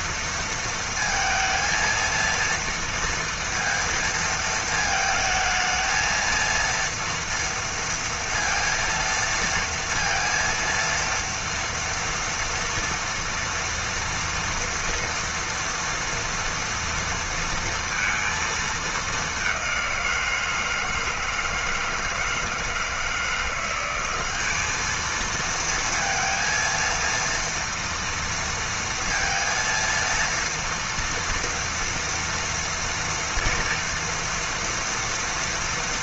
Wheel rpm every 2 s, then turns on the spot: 230, 230, 220, 230, 230, 230, 230, 230, 230, 210, 160, 160, 220, 230, 230, 230, 230, 230.
none